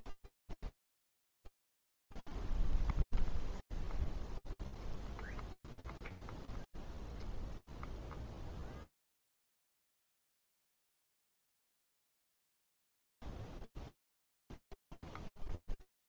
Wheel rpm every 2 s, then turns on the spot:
0, 0, 0, 0, 0, 0, 0, 0.
none